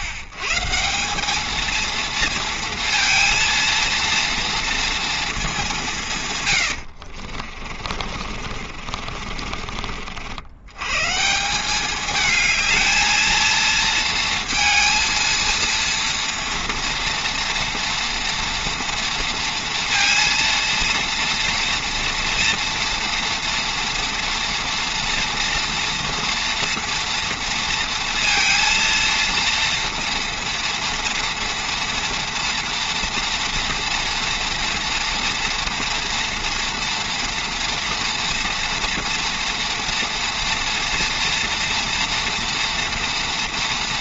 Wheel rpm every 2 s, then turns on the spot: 130, 230, 230, 120, 40, 80, 220, 230, 230, 230, 230, 240, 230, 240, 230, 230, 240, 230, 230, 230, 230, 230.
6-10